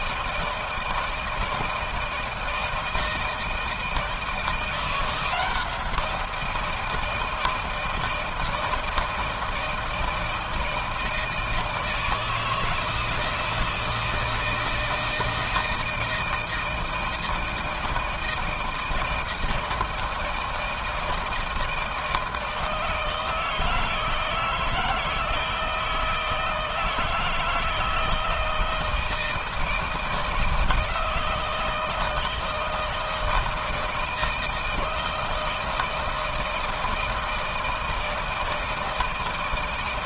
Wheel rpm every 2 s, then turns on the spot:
160, 160, 170, 170, 160, 160, 160, 160, 160, 160, 160, 160, 160, 160, 160, 160, 160, 160, 160, 160.
none